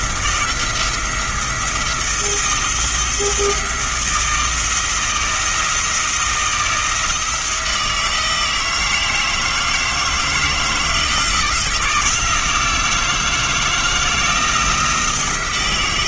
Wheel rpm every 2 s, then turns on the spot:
170, 170, 160, 160, 160, 160, 160, 170.
none